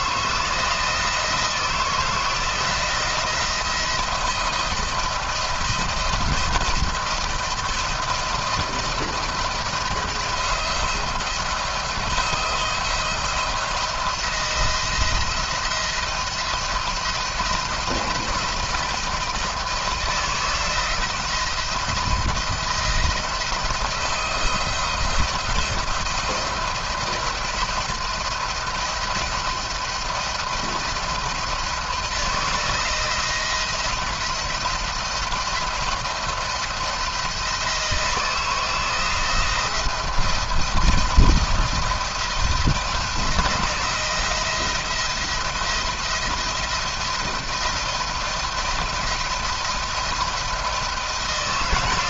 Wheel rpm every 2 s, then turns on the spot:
160, 170, 170, 170, 170, 170, 170, 170, 170, 160, 160, 160, 170, 170, 170, 160, 170, 170, 160, 170, 170, 170, 170, 170, 170, 160.
none